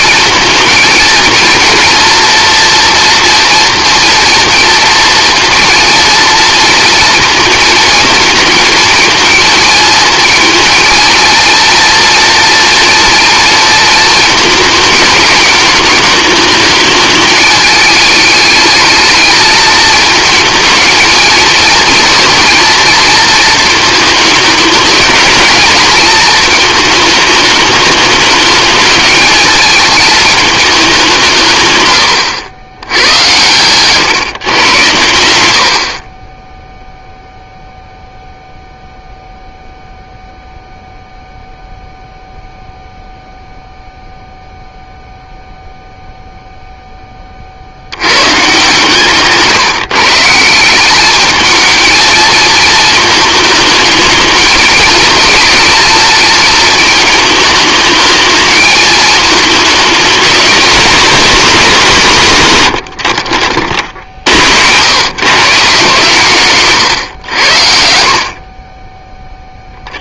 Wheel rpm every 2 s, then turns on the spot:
230, 240, 230, 230, 220, 230, 240, 220, 220, 220, 220, 230, 210, 220, 220, 200, 90, 110, 0, 0, 0, 0, 0, 10, 150, 200, 220, 220, 220, 220, 230, 90, 120, 130, 20.
34-36 62-64